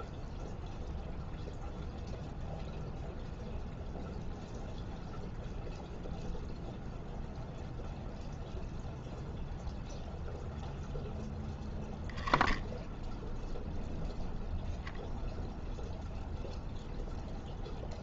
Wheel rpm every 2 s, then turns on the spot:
0, 0, 0, 0, 0, 0, 0, 0, 0.
none